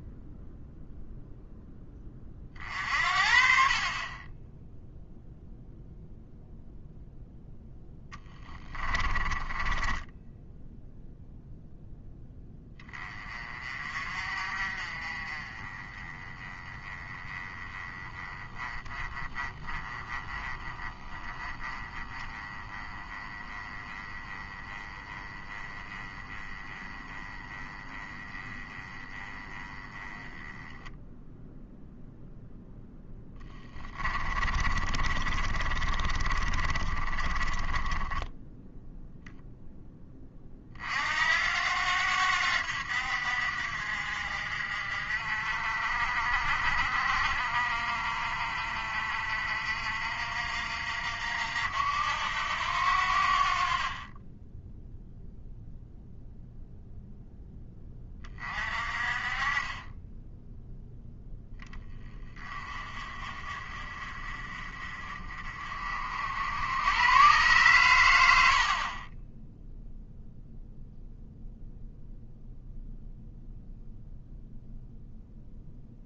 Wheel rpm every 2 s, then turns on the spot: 0, 50, 0, 0, 10, 0, 20, 40, 20, 20, 20, 20, 20, 20, 20, 10, 10, 30, 30, 0, 50, 70, 50, 50, 50, 60, 80, 0, 0, 40, 0, 30, 40, 100, 40, 0, 0, 0.
8-10 34-38